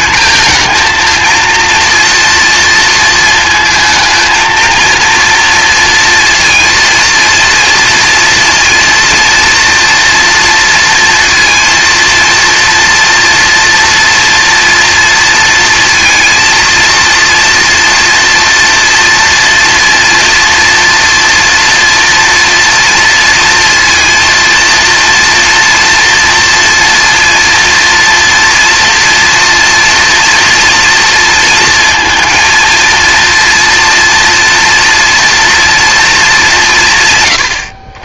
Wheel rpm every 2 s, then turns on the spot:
230, 230, 230, 230, 230, 230, 230, 230, 230, 230, 230, 230, 230, 230, 230, 230, 230, 230, 160.
none